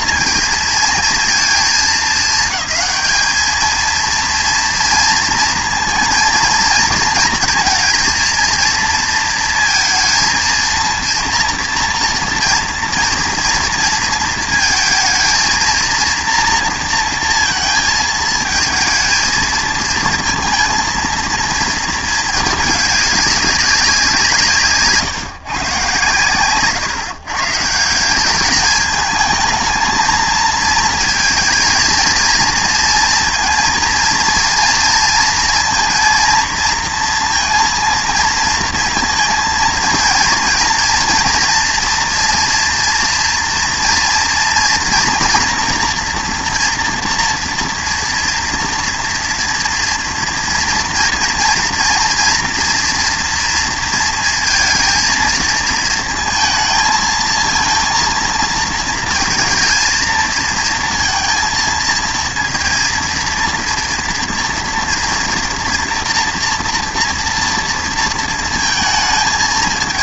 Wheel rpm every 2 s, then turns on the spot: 230, 200, 230, 230, 230, 220, 240, 230, 230, 230, 230, 210, 150, 130, 210, 230, 230, 230, 230, 230, 230, 230, 240, 230, 230, 230, 240, 230, 220, 230, 230, 230, 230, 230, 230.
none